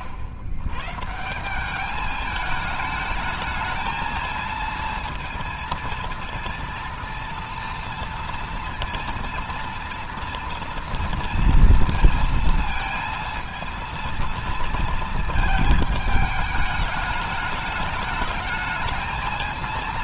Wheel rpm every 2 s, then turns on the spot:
110, 210, 230, 230, 230, 230, 230, 230, 210, 220.
none